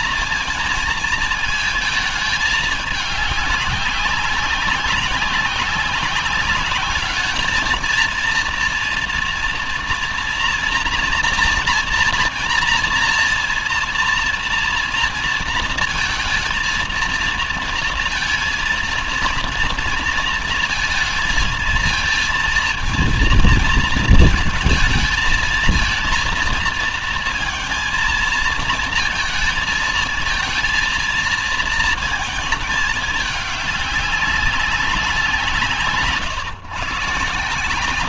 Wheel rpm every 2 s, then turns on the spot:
220, 210, 200, 210, 230, 240, 230, 230, 220, 230, 230, 230, 220, 230, 230, 230, 210, 180, 130.
none